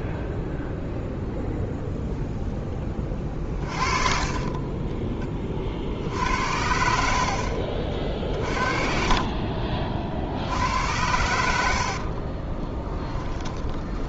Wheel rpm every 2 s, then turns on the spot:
0, 20, 20, 70, 40, 90, 20.
2-6 12-14